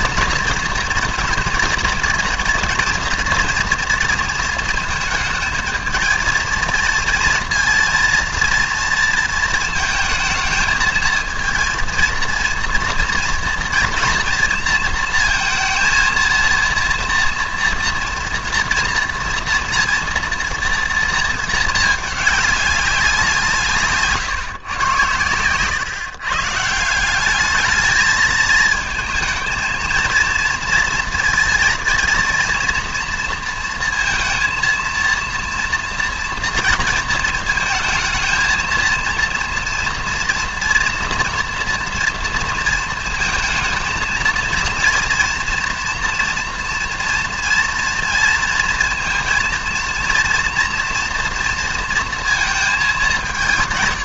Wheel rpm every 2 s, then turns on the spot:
230, 230, 230, 230, 230, 220, 230, 230, 230, 230, 230, 200, 120, 150, 220, 230, 230, 230, 230, 230, 230, 230, 230, 230, 230, 230, 220.
none